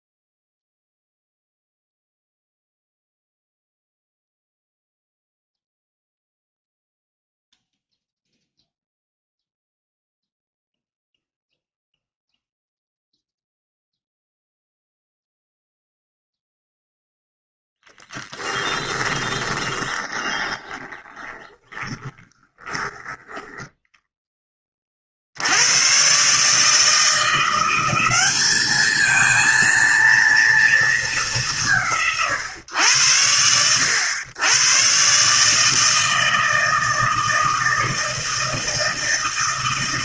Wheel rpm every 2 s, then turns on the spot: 0, 0, 0, 0, 0, 0, 0, 0, 0, 20, 20, 10, 10, 140, 210, 230, 140, 110, 160, 160.
18-24